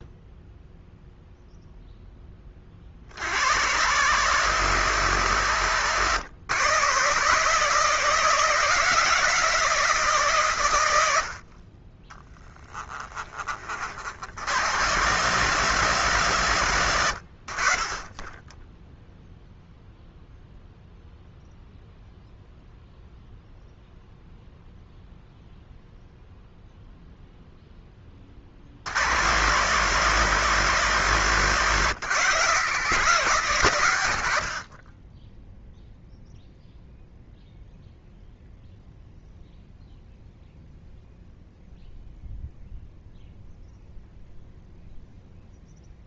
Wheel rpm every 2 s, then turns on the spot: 0, 30, 140, 130, 160, 120, 30, 90, 120, 10, 0, 0, 0, 0, 40, 140, 150, 60, 0, 0, 0, 0, 0.
12-14